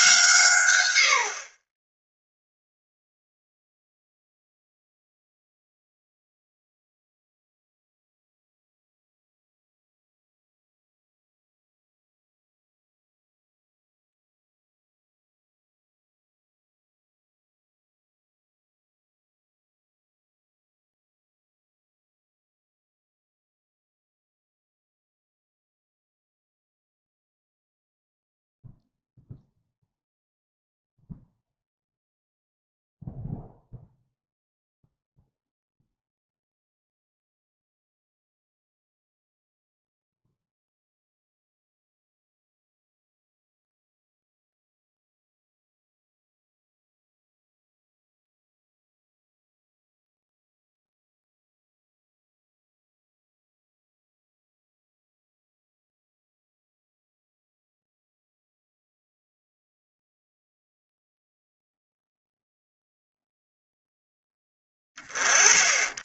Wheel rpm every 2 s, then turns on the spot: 120, 0, 0, 0, 0, 0, 0, 0, 0, 0, 0, 0, 0, 0, 0, 0, 0, 0, 0, 0, 0, 0, 0, 0, 0, 0, 0, 0, 0, 0, 0, 0, 10.
none